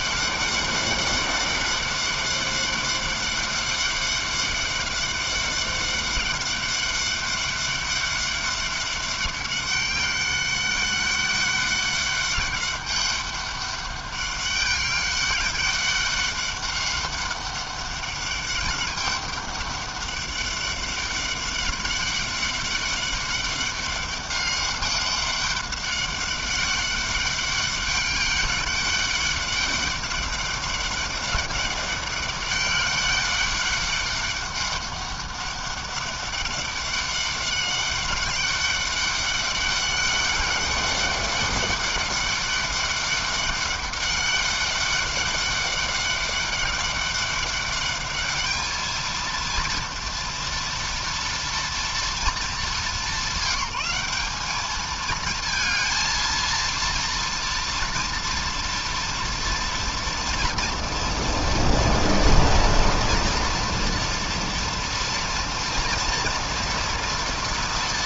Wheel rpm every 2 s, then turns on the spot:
200, 200, 200, 200, 200, 200, 200, 200, 200, 200, 200, 200, 200, 200, 200, 200, 200, 200, 200, 200, 200, 200, 200, 200, 210, 230, 220, 210, 230, 230, 230, 230, 230, 240.
none